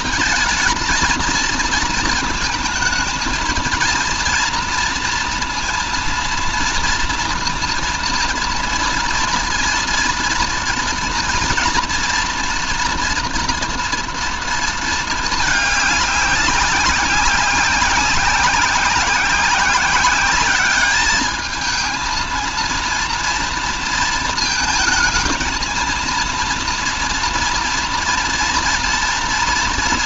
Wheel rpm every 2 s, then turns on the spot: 230, 220, 230, 230, 240, 240, 240, 220, 190, 190, 200, 230, 220, 230, 230.
none